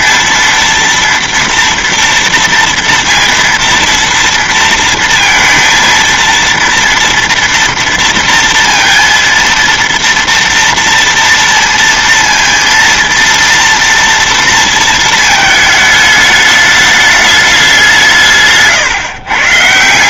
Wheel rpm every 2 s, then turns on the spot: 230, 230, 230, 230, 230, 230, 230, 230, 210, 140.
18-20